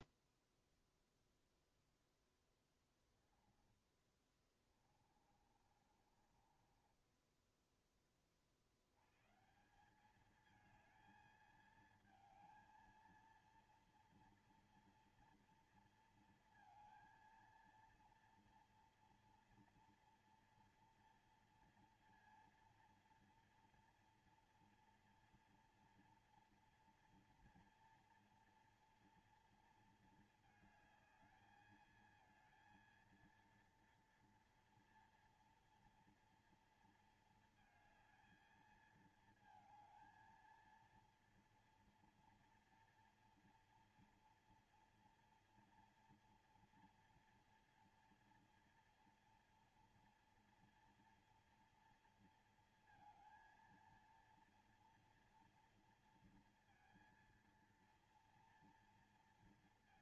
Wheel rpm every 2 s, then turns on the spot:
0, 0, 20, 30, 40, 210, 220, 230, 230, 230, 230, 240, 240, 230, 230, 220, 220, 230, 230, 220, 230, 240, 240, 230, 230, 230, 230, 230, 230, 230.
4-8